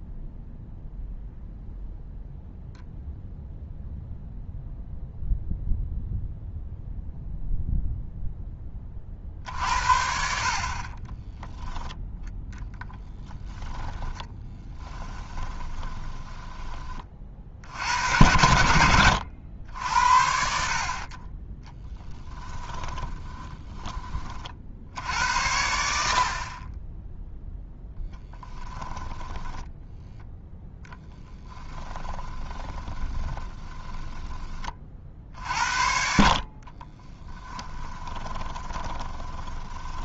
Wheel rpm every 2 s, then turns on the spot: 0, 0, 0, 0, 30, 40, 20, 20, 30, 80, 50, 10, 60, 20, 10, 0, 20, 40, 30, 20.
10-16 22-24 28-30 32-34 36-40